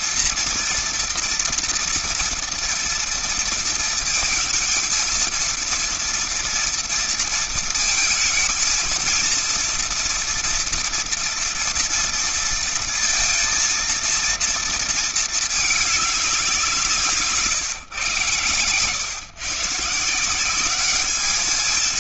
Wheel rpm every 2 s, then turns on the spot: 230, 230, 230, 230, 230, 230, 230, 230, 190, 120, 190.
none